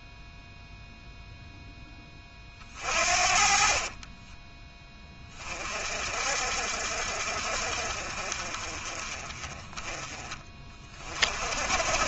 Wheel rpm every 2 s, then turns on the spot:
0, 40, 20, 60, 30, 30.
none